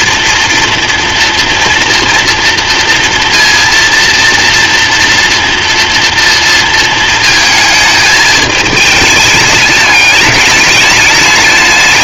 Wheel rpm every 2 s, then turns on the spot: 230, 230, 230, 230, 210, 210.
none